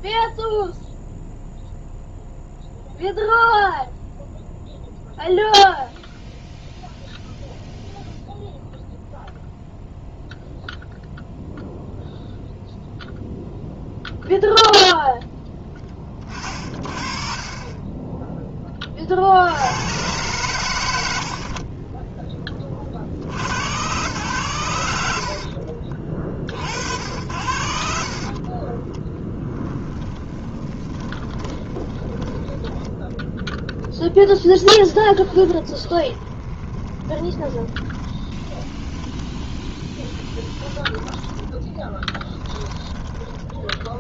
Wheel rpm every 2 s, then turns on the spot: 0, 0, 0, 0, 0, 0, 0, 0, 30, 30, 130, 60, 80, 90, 0, 20, 10, 10, 20, 20, 10, 20.
30-32 34-44